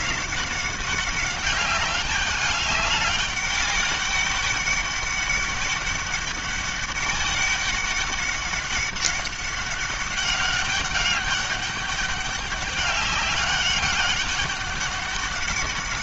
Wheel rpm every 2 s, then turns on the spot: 200, 200, 200, 200, 190, 200, 200, 200.
none